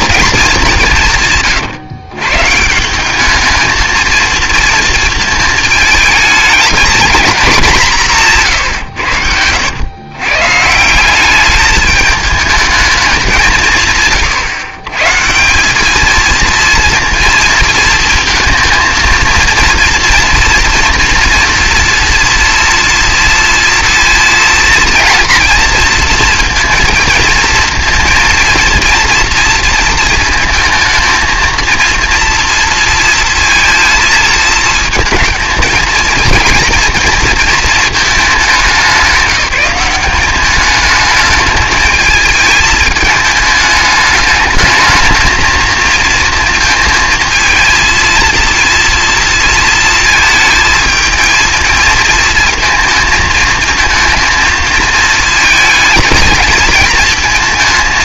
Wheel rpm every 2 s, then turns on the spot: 200, 150, 230, 220, 140, 140, 220, 130, 230, 220, 230, 240, 230, 230, 230, 230, 230, 220, 230, 200, 200, 220, 220, 220, 230, 220, 230, 230, 220.
none